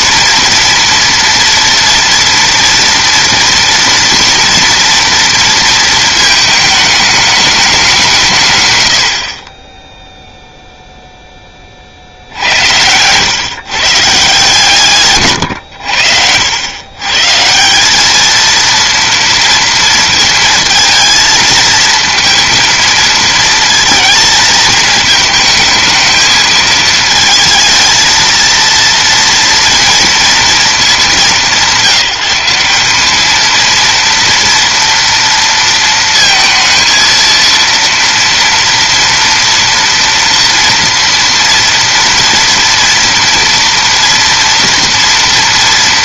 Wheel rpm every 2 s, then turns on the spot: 230, 230, 230, 220, 120, 0, 90, 140, 100, 230, 230, 230, 220, 220, 230, 220, 190, 230, 230, 230, 230, 230, 230.
none